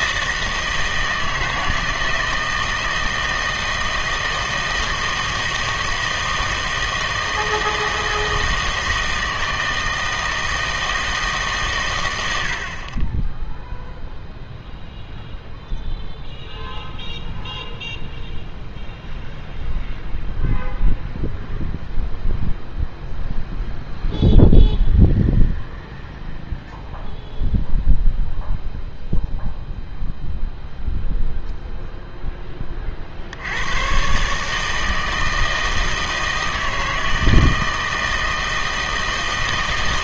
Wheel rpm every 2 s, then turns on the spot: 160, 160, 160, 160, 160, 160, 80, 0, 0, 0, 0, 0, 0, 0, 0, 0, 20, 150, 160, 160.
none